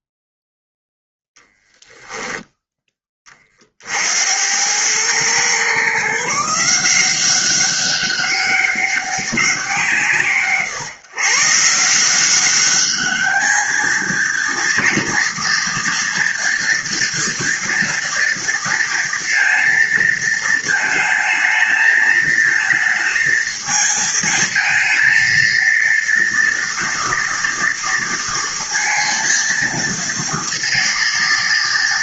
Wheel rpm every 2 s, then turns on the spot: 0, 10, 90, 160, 200, 140, 190, 230, 230, 230, 220, 220, 230, 230, 230, 230.
none